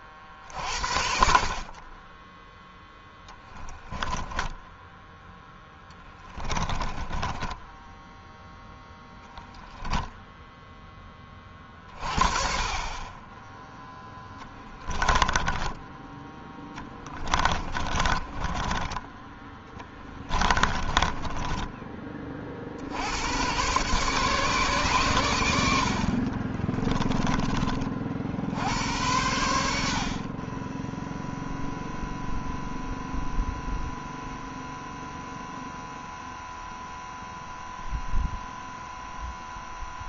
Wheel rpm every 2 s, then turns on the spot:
60, 0, 0, 10, 0, 10, 30, 20, 10, 10, 10, 80, 130, 20, 80, 10, 0, 0, 0, 0.
14-22 26-28